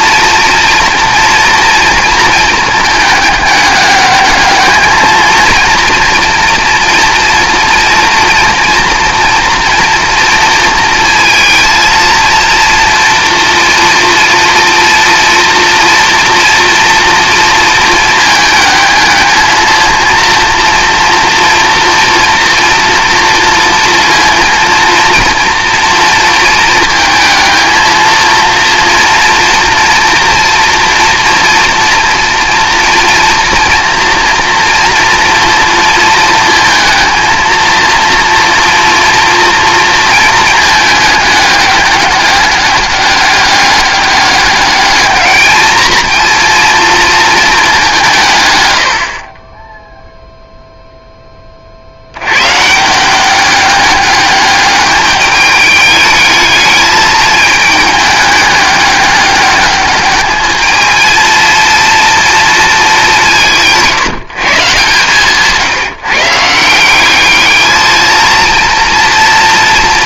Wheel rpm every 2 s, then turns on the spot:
230, 220, 220, 230, 230, 230, 230, 230, 230, 220, 230, 230, 230, 230, 230, 230, 240, 230, 220, 230, 220, 210, 210, 230, 100, 0, 160, 210, 210, 200, 220, 220, 140, 180, 230.
none